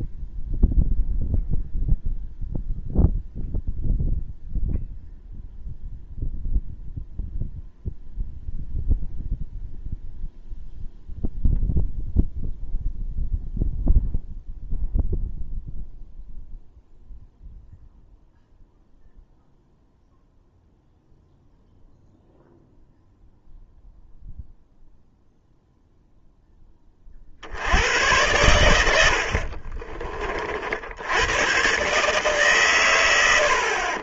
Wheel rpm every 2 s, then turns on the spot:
0, 0, 0, 0, 0, 0, 0, 0, 0, 0, 0, 0, 0, 20, 100, 60, 130.
none